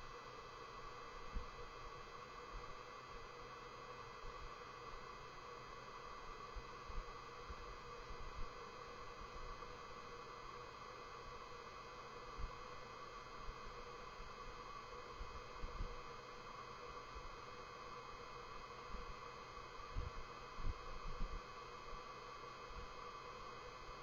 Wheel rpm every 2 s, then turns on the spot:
0, 0, 0, 0, 0, 0, 0, 0, 0, 0, 0, 0.
none